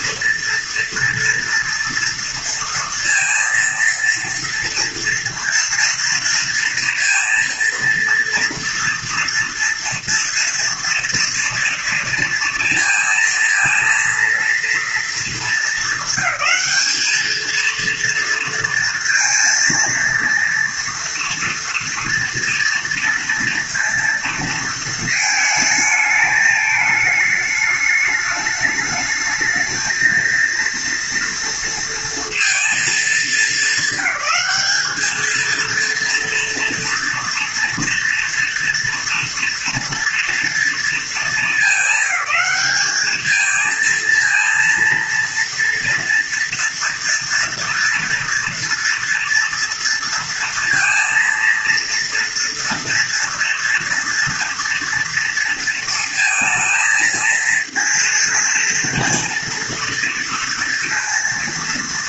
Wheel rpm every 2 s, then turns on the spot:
230, 230, 230, 230, 230, 230, 230, 230, 220, 230, 230, 230, 230, 220, 210, 230, 230, 200, 230, 230, 230, 210, 230, 230, 230, 230, 240, 230, 230, 230, 230.
none